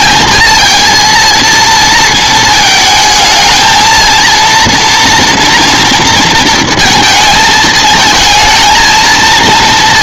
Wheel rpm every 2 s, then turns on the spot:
220, 220, 230, 230, 220.
none